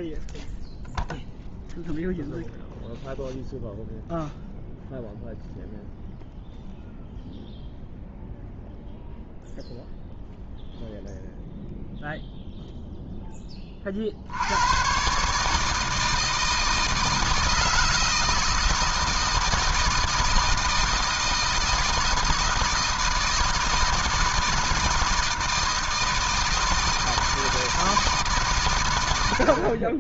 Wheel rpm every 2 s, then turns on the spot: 0, 0, 0, 0, 0, 0, 0, 100, 160, 160, 160, 160, 160, 160, 130.
none